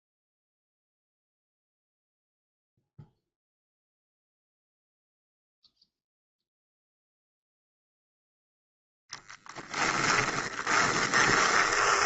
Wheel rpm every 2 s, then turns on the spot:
0, 0, 0, 0, 0, 20.
10-12